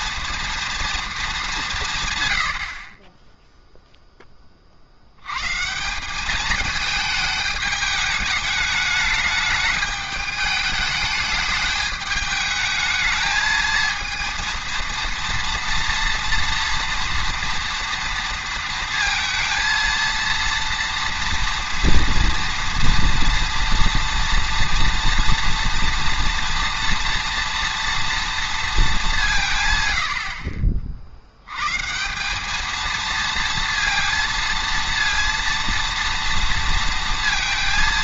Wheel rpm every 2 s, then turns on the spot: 230, 50, 40, 210, 210, 210, 210, 230, 230, 230, 230, 230, 230, 230, 220, 50, 220, 230, 230.
none